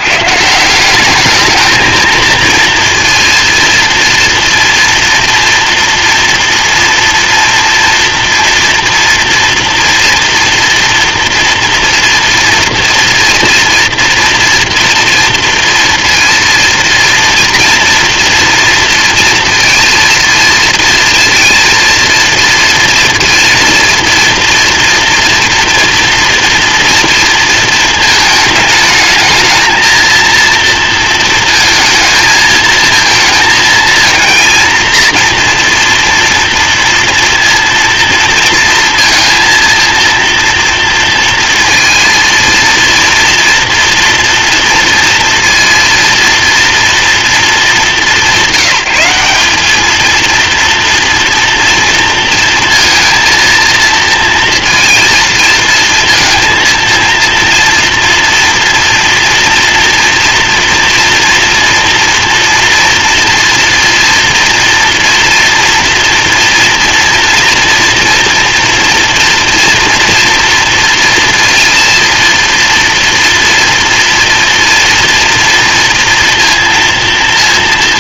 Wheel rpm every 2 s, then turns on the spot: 160, 230, 230, 230, 230, 230, 240, 230, 230, 230, 230, 230, 240, 240, 220, 230, 220, 230, 230, 230, 230, 230, 230, 230, 200, 230, 230, 230, 230, 230, 240, 230, 230, 230, 230, 230, 230, 230, 230.
none